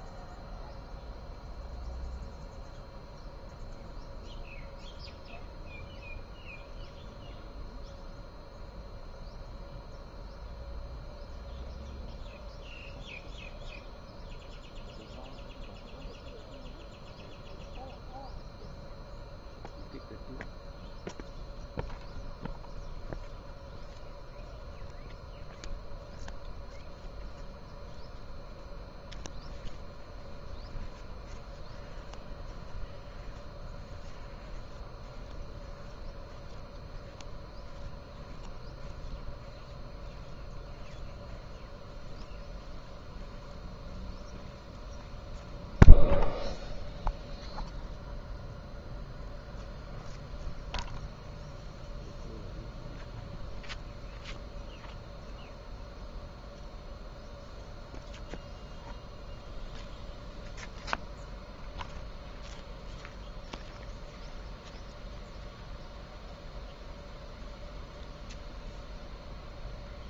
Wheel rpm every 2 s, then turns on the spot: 0, 0, 0, 0, 0, 0, 0, 0, 0, 0, 0, 0, 0, 0, 0, 0, 0, 0, 0, 0, 0, 0, 0, 0, 0, 0, 0, 0, 0, 0, 0, 0, 0, 0, 0.
none